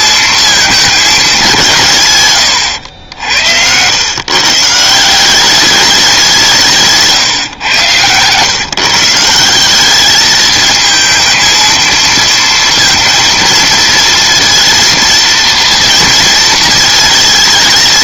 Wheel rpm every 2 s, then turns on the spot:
220, 110, 150, 160, 140, 220, 230, 230, 220.
none